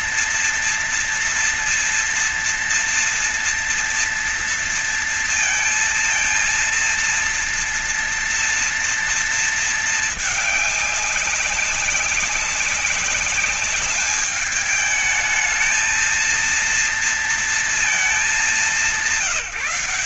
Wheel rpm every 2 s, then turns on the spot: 230, 230, 230, 230, 230, 210, 190, 210, 230, 210.
none